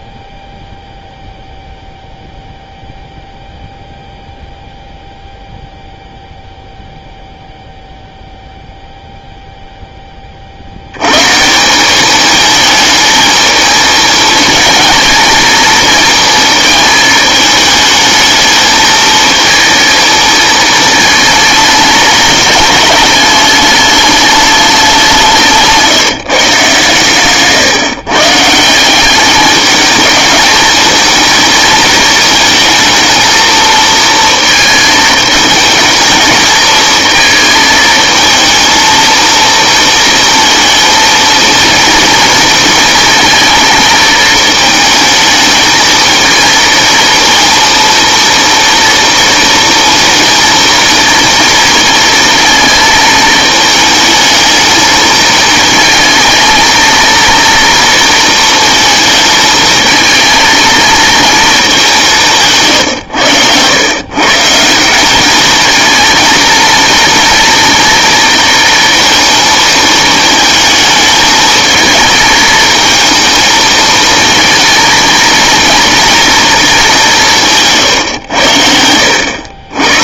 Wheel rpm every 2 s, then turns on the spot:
0, 0, 0, 0, 0, 70, 220, 220, 230, 220, 220, 210, 210, 150, 170, 220, 220, 220, 220, 220, 230, 230, 220, 230, 230, 230, 220, 210, 230, 230, 230, 130, 160, 230, 230, 220, 230, 230, 220, 80.
78-80